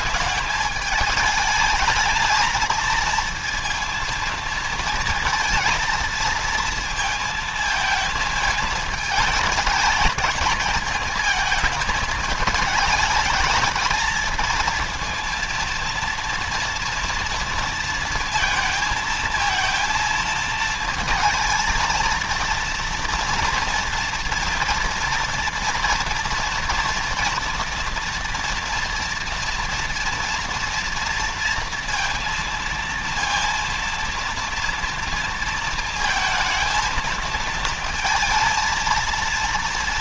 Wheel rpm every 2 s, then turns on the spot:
210, 220, 230, 230, 220, 220, 220, 220, 230, 230, 220, 230, 230, 230, 230, 230, 230, 230, 220, 230.
none